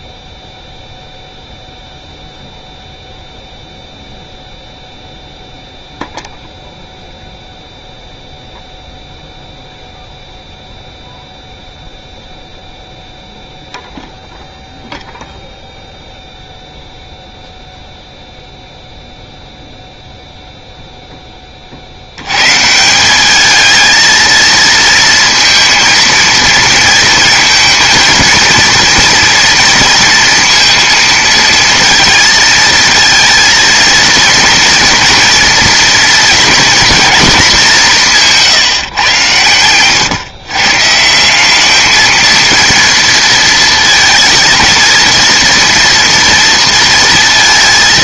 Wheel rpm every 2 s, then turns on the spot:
0, 0, 0, 0, 0, 0, 0, 0, 0, 0, 0, 140, 230, 230, 230, 230, 220, 230, 230, 150, 120, 230, 230, 230.
38-40